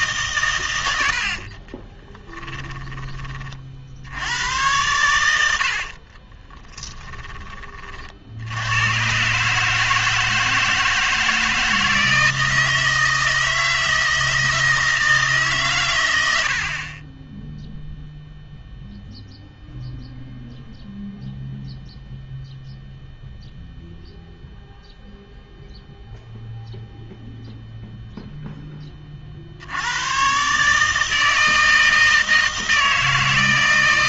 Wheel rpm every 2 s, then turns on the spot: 110, 20, 110, 30, 90, 160, 160, 160, 50, 0, 0, 0, 0, 0, 10, 150, 160.
2-4 6-8